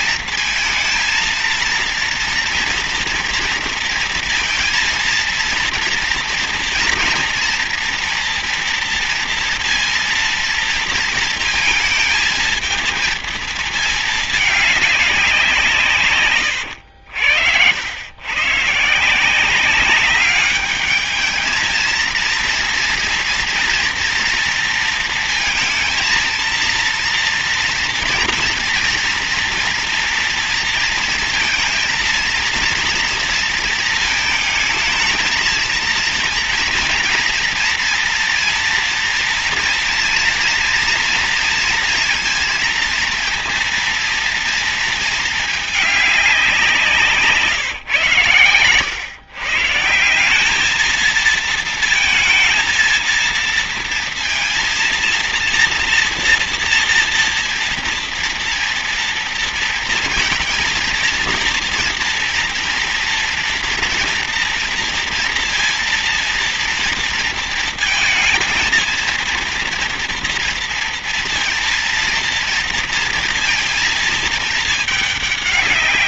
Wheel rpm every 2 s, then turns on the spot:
220, 230, 230, 230, 230, 230, 220, 210, 110, 130, 200, 230, 230, 230, 230, 230, 230, 220, 230, 230, 230, 230, 230, 190, 120, 200, 220, 230, 240, 230, 230, 230, 230, 230, 220, 230, 230, 220.
48-50